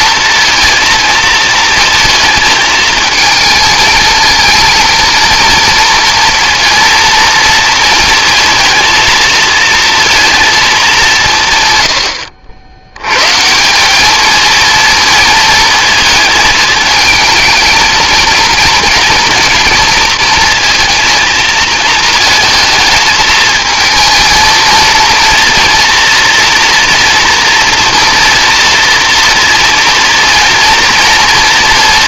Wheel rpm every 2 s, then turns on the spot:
220, 220, 230, 230, 220, 180, 130, 220, 220, 230, 230, 220, 230, 240, 230, 200.
none